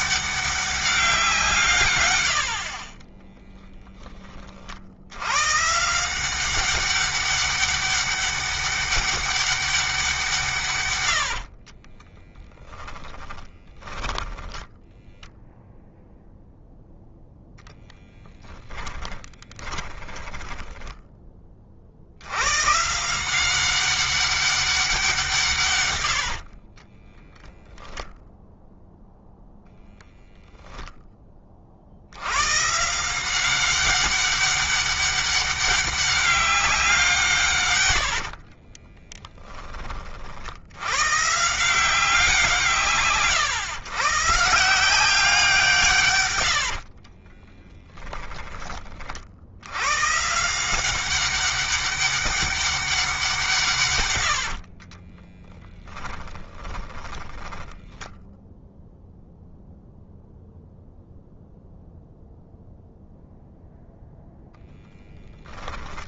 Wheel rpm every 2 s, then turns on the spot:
190, 40, 60, 180, 200, 130, 10, 10, 0, 20, 10, 140, 190, 40, 0, 0, 140, 200, 180, 20, 110, 160, 160, 70, 40, 180, 190, 50, 10, 0, 0, 0, 10.
12-14 18-22 26-28 38-40 46-48 54-58 64-66